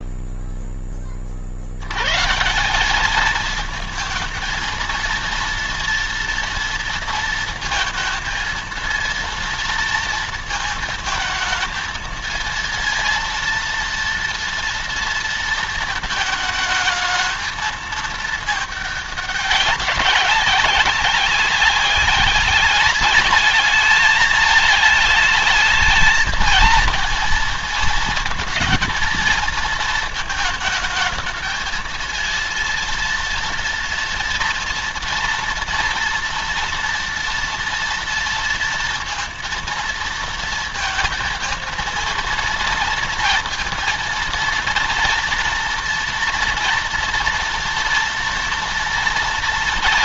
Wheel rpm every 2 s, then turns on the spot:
0, 170, 230, 230, 230, 230, 230, 230, 220, 210, 190, 210, 220, 220, 230, 220, 230, 230, 230, 230, 230, 230, 230, 230, 240.
none